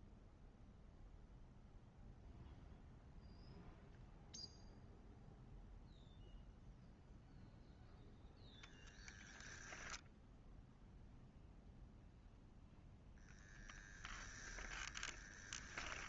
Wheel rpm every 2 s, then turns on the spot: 0, 0, 0, 0, 10, 0, 0, 10.
none